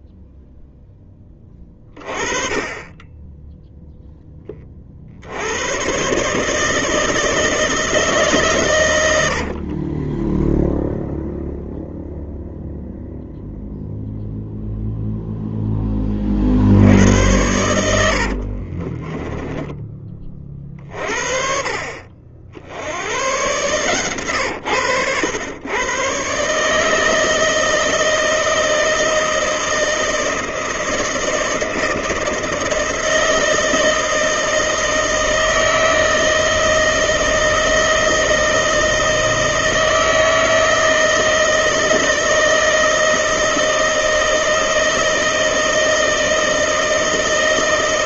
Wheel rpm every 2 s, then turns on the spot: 0, 30, 30, 160, 130, 0, 0, 0, 60, 40, 30, 70, 110, 150, 160, 160, 160, 160, 160, 160, 160, 160, 160, 160.
18-20